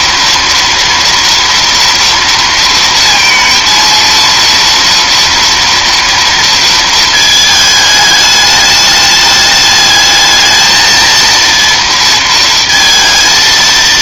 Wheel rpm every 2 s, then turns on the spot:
230, 230, 230, 230, 210, 220, 230.
none